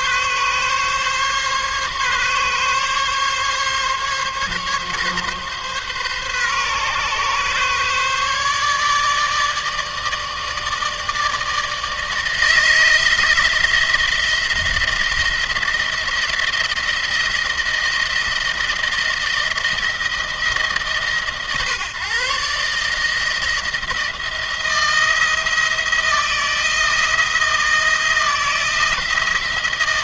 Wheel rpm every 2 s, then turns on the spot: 140, 140, 140, 130, 150, 160, 160, 170, 170, 160, 150, 150, 170, 170, 170.
none